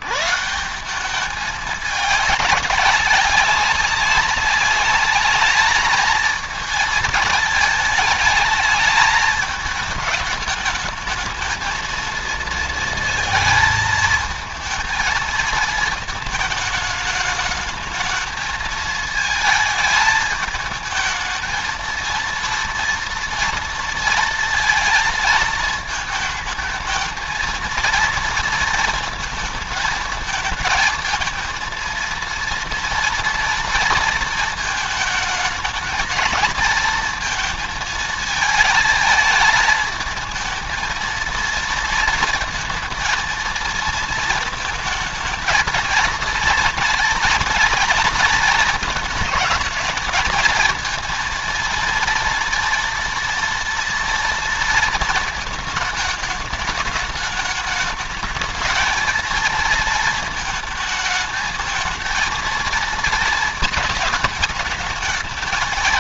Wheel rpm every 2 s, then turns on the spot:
190, 200, 200, 220, 220, 220, 230, 230, 210, 220, 220, 230, 230, 220, 230, 220, 230, 220, 230, 220, 230, 220, 220, 240, 220, 220, 230, 230, 210, 220, 220, 230, 220.
none